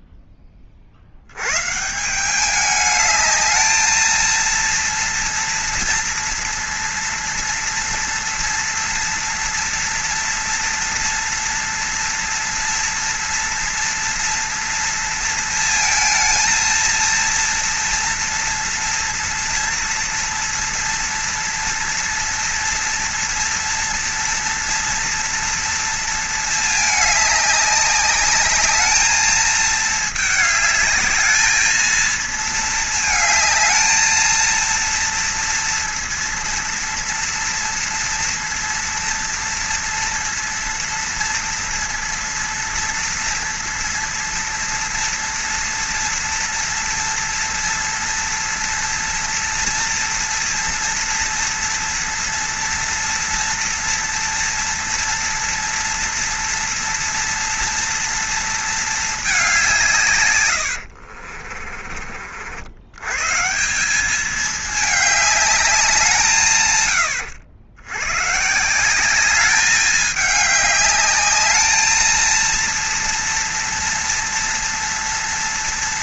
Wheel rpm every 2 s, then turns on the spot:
40, 210, 230, 230, 230, 230, 230, 230, 230, 240, 230, 230, 230, 220, 210, 210, 220, 230, 240, 230, 230, 230, 230, 230, 240, 230, 240, 230, 240, 220, 90, 80, 210, 120, 160, 210, 230, 230.
60-62